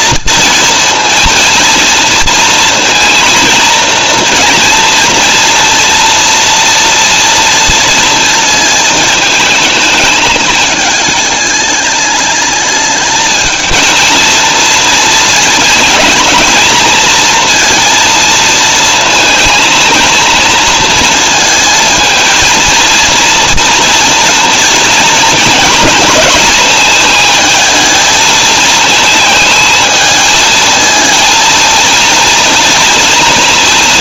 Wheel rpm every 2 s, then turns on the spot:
230, 230, 230, 230, 220, 220, 210, 230, 220, 220, 230, 230, 230, 220, 220, 230, 230.
none